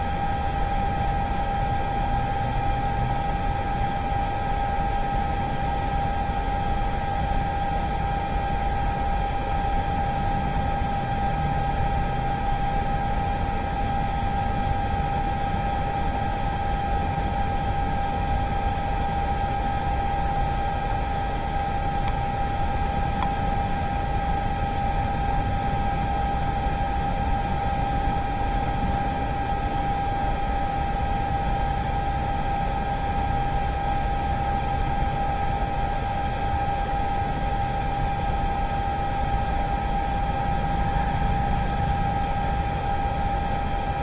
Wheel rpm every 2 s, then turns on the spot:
0, 0, 0, 0, 0, 0, 0, 0, 0, 0, 0, 0, 0, 0, 0, 0, 0, 0, 0, 0, 0, 0.
none